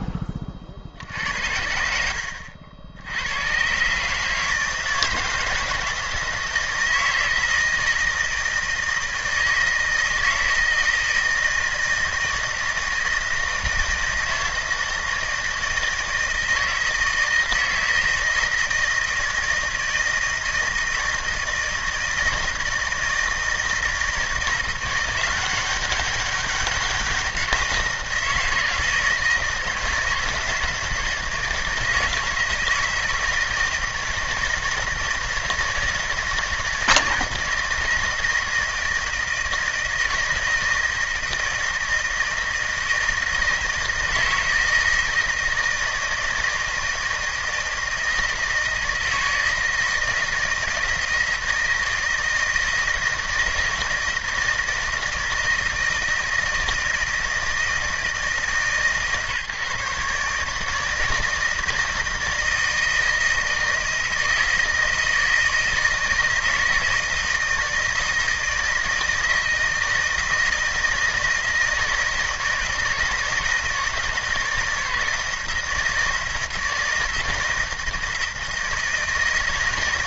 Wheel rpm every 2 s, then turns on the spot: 50, 70, 160, 160, 160, 160, 160, 160, 160, 160, 160, 160, 170, 200, 160, 160, 160, 160, 160, 160, 160, 160, 160, 160, 160, 160, 160, 160, 160, 150, 150, 160, 160, 160, 160, 160, 160, 160, 160, 160.
none